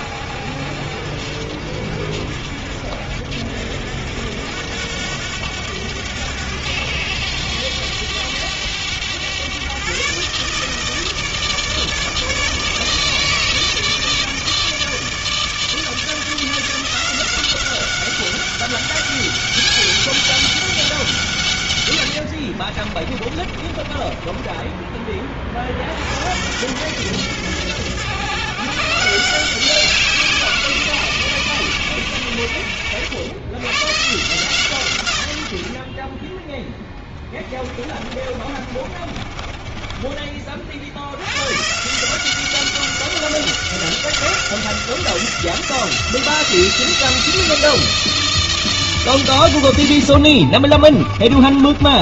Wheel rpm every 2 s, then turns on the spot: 60, 70, 90, 100, 100, 150, 150, 160, 170, 200, 200, 50, 20, 100, 130, 160, 80, 140, 10, 40, 50, 190, 180, 170, 160, 40.
22-26 36-40 50-52